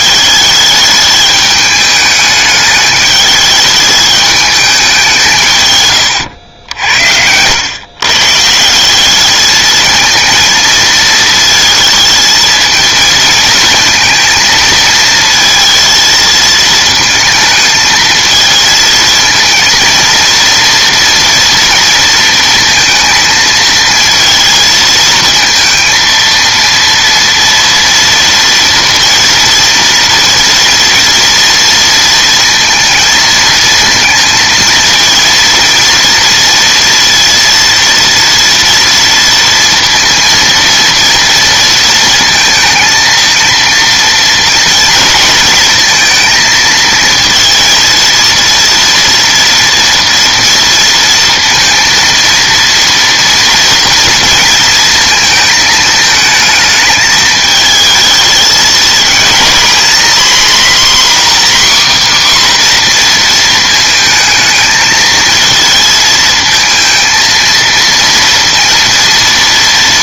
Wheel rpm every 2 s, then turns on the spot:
210, 210, 210, 80, 170, 230, 220, 230, 220, 220, 230, 230, 230, 230, 230, 240, 230, 230, 230, 230, 230, 220, 230, 220, 230, 230, 230, 230, 220, 220, 250, 260, 220, 220, 230.
none